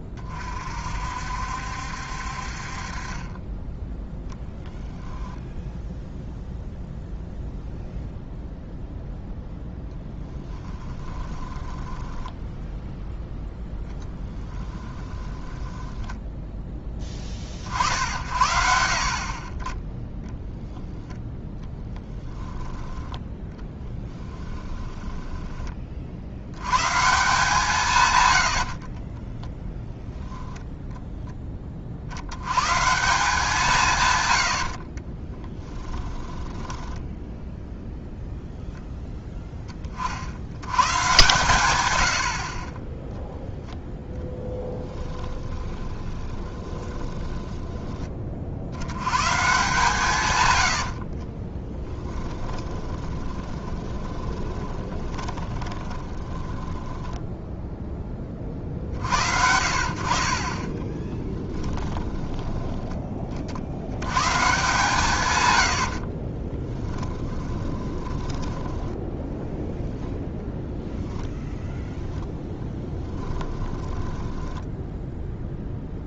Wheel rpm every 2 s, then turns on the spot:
60, 30, 0, 0, 0, 20, 0, 10, 20, 50, 0, 0, 10, 140, 30, 0, 160, 30, 10, 0, 130, 10, 10, 20, 120, 60, 20, 20, 10, 60, 10, 30, 130, 10, 10, 0, 10, 0.
10-12 14-16 24-26 28-30 34-38 44-48 50-58 60-62 66-70 72-74